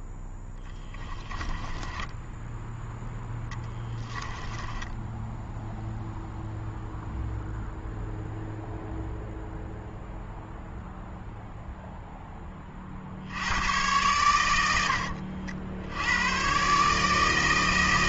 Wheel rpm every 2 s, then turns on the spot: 10, 10, 10, 0, 0, 0, 30, 90, 130.
0-6